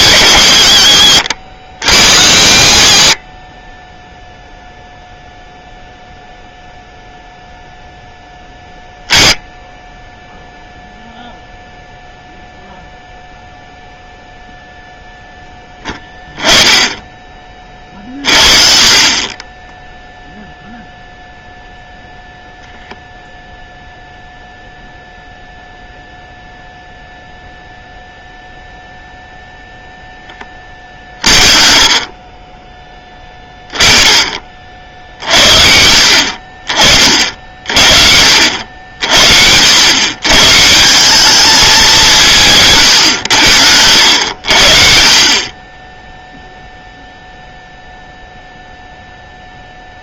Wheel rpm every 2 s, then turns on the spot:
80, 50, 0, 0, 10, 0, 0, 0, 10, 40, 0, 0, 0, 0, 0, 30, 20, 50, 40, 70, 170, 130, 50, 0, 0.
30-32 42-46